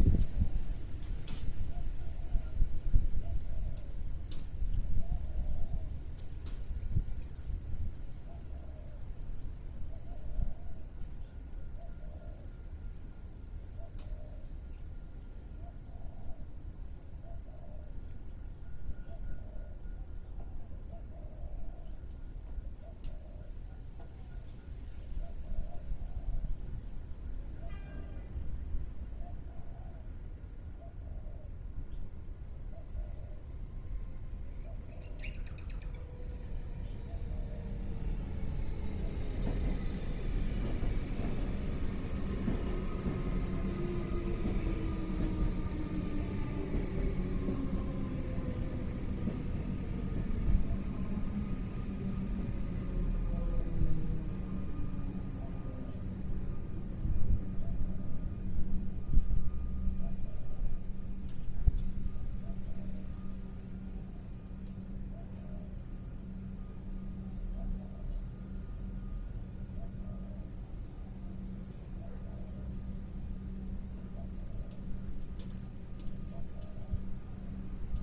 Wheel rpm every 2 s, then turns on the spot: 0, 0, 0, 0, 0, 0, 0, 0, 0, 0, 0, 0, 0, 0, 0, 0, 0, 0, 0, 0, 0, 0, 0, 0, 0, 0, 0, 0, 0, 0, 0, 0, 0, 0, 0, 0, 0, 0, 0.
none